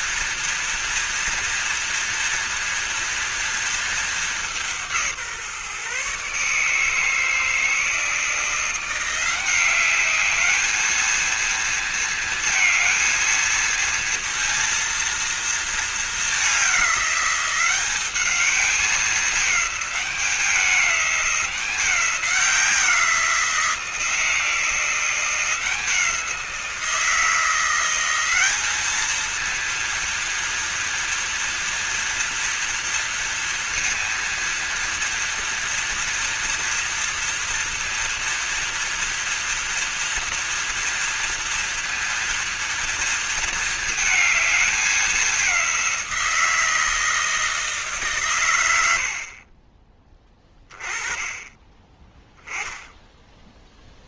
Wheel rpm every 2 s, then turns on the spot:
230, 230, 200, 140, 160, 200, 230, 230, 210, 200, 200, 180, 170, 170, 190, 230, 230, 230, 230, 230, 240, 230, 220, 170, 130, 20, 10.
none